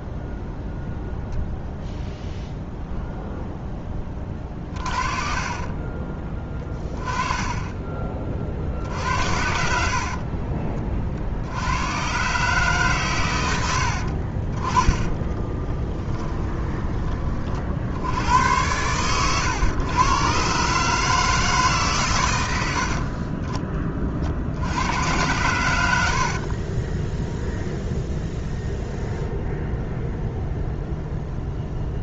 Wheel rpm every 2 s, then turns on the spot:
0, 0, 30, 20, 60, 40, 140, 30, 20, 110, 140, 80, 80, 20, 0, 0.
4-8 14-16 26-28